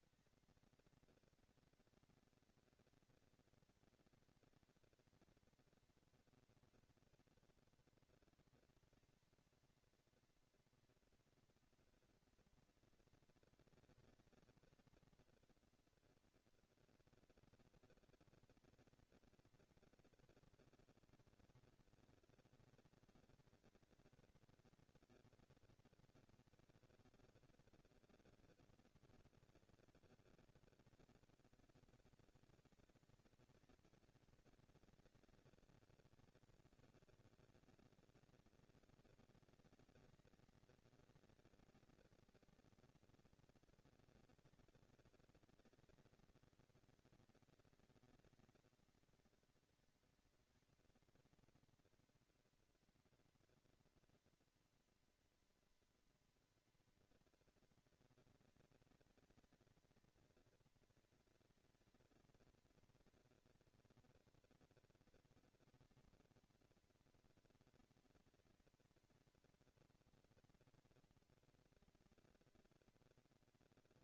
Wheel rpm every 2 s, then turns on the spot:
230, 230, 230, 240, 230, 240, 230, 220, 230, 230, 220, 220, 230, 230, 230, 200, 190, 210, 200, 230, 220, 230, 230, 230, 230, 240, 230, 240, 230, 230, 220, 220, 230, 240, 230, 230, 230.
none